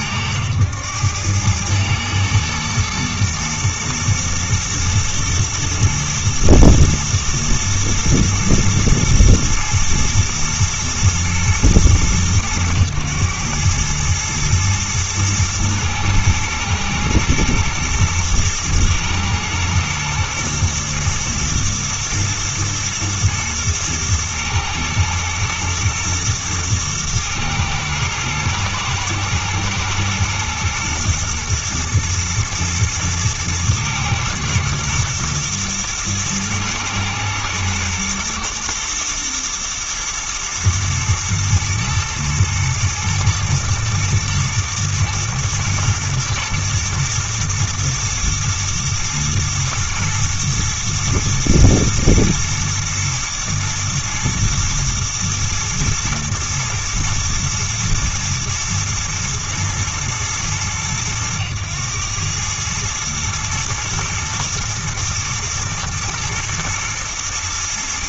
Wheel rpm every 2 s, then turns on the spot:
100, 110, 120, 110, 110, 120, 110, 110, 110, 120, 120, 110, 110, 110, 110, 120, 110, 110, 110, 110, 110, 110, 110, 110, 120, 110, 110, 110, 110, 120, 110, 110, 110, 110.
none